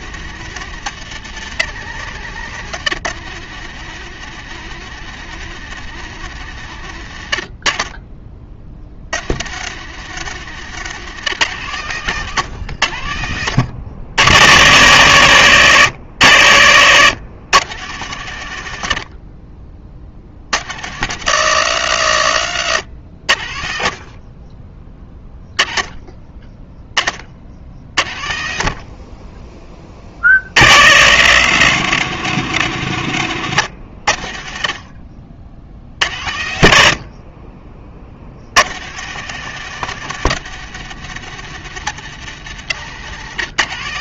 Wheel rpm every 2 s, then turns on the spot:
140, 120, 140, 80, 80, 130, 90, 90, 90, 60, 120, 80, 10, 30, 30, 100, 110, 50, 50, 140, 140, 120.
42-44